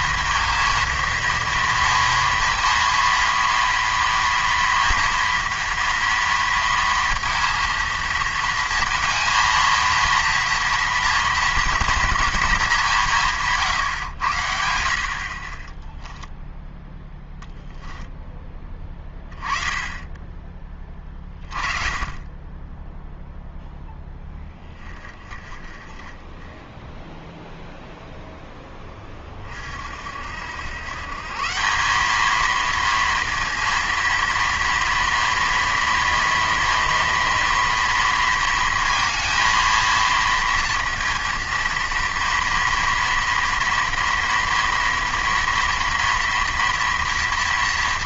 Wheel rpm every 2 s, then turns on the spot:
230, 230, 230, 230, 230, 230, 210, 70, 10, 10, 20, 20, 20, 10, 10, 100, 230, 230, 230, 230, 230, 240, 240, 230.
none